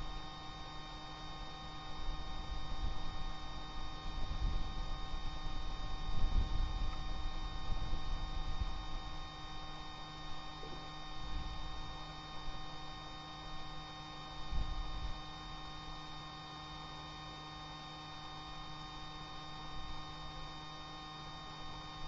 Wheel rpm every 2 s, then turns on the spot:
0, 0, 0, 0, 0, 0, 0, 0, 0, 0, 0.
none